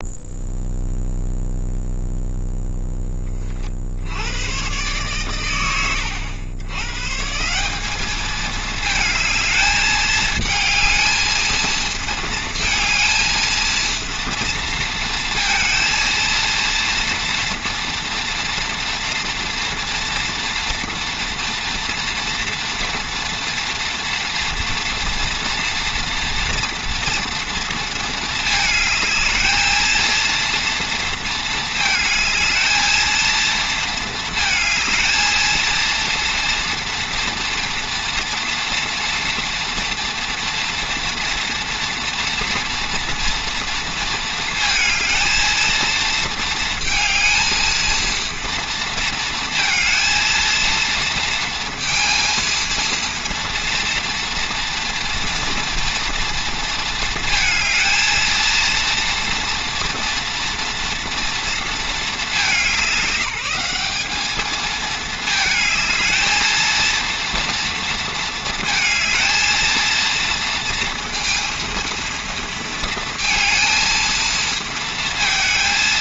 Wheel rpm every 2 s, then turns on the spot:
0, 10, 120, 130, 220, 220, 220, 230, 230, 230, 230, 230, 240, 230, 220, 230, 220, 220, 230, 240, 230, 230, 220, 220, 230, 230, 230, 230, 220, 230, 230, 190, 220, 230, 220, 230, 230, 230.
none